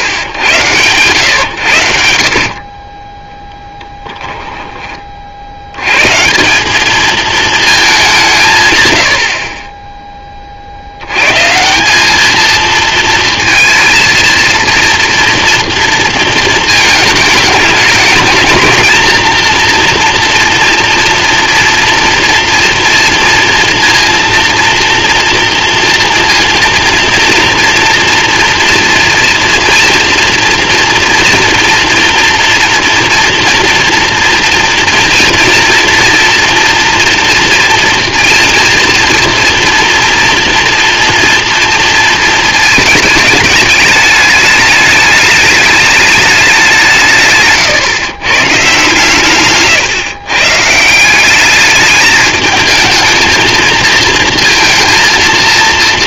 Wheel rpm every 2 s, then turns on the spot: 100, 30, 20, 200, 130, 70, 230, 230, 220, 220, 240, 230, 230, 230, 240, 230, 230, 230, 240, 230, 230, 220, 210, 180, 130, 160, 220, 230.
none